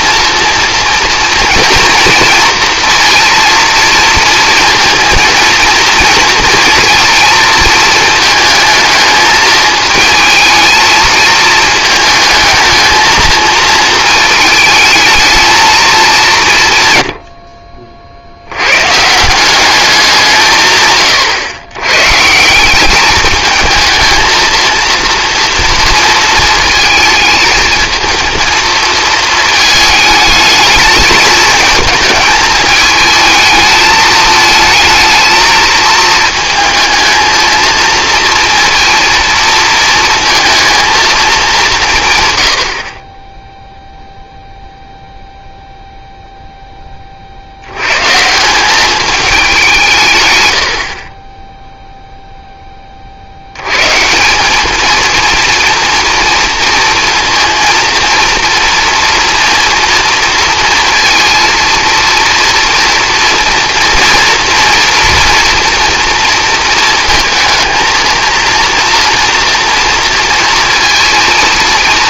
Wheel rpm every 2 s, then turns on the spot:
230, 230, 230, 230, 220, 220, 220, 220, 170, 100, 160, 170, 230, 220, 220, 210, 210, 220, 220, 230, 230, 90, 0, 10, 200, 80, 10, 210, 230, 230, 230, 230, 240, 230, 230, 230.
none